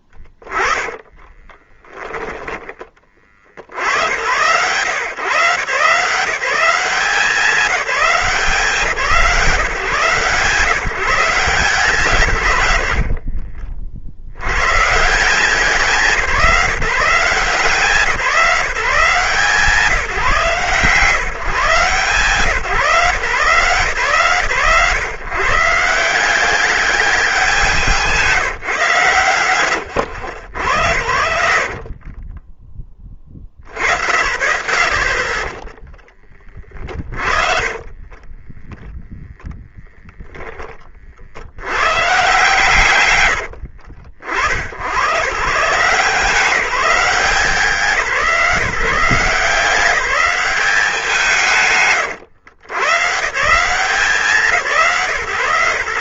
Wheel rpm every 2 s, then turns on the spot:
10, 10, 70, 160, 180, 130, 140, 70, 170, 150, 160, 140, 120, 180, 170, 100, 30, 60, 20, 20, 10, 140, 80, 190, 170, 200, 130, 170.
0-4 38-40